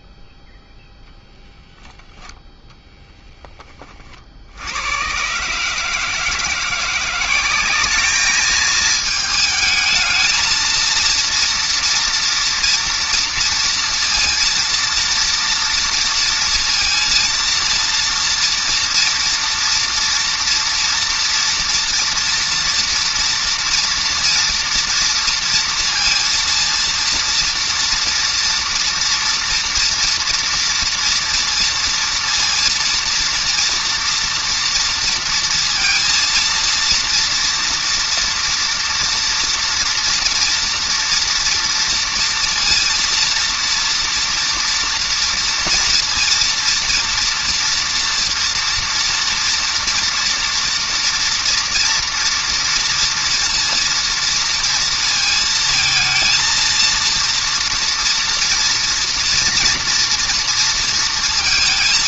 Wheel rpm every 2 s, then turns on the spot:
0, 10, 20, 150, 200, 220, 230, 230, 230, 230, 230, 230, 230, 230, 230, 230, 230, 230, 230, 230, 230, 230, 230, 240, 230, 230, 230, 230, 220, 230, 230.
none